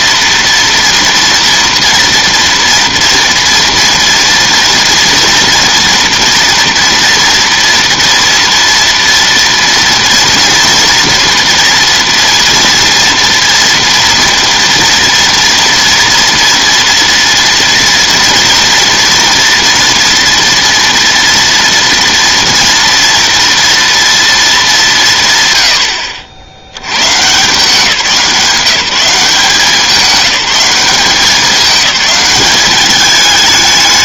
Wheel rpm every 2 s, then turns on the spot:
230, 230, 230, 240, 230, 230, 240, 240, 230, 230, 230, 230, 210, 90, 180, 190, 200.
none